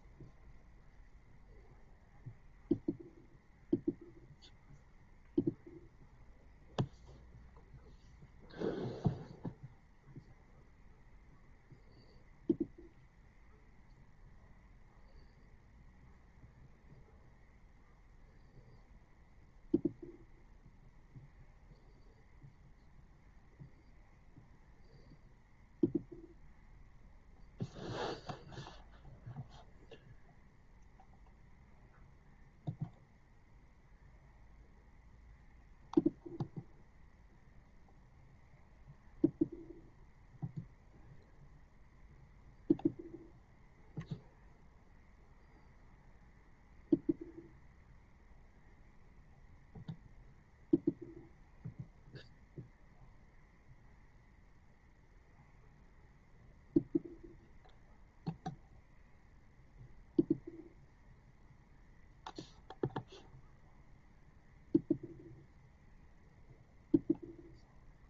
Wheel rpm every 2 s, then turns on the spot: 0, 0, 0, 0, 0, 0, 0, 0, 0, 0, 0, 0, 0, 0, 0, 0, 0, 0, 0, 0, 0, 0, 0, 0, 0, 0, 0, 0, 0, 0, 0, 0, 0, 0.
none